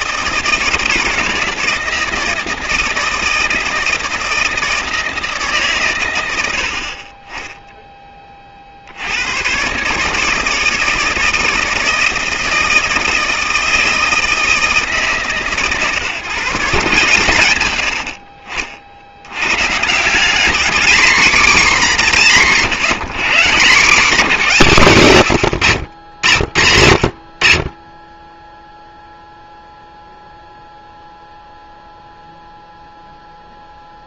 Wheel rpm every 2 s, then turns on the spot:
160, 160, 160, 60, 40, 160, 160, 160, 140, 50, 220, 190, 180, 80, 10, 0, 0.
22-24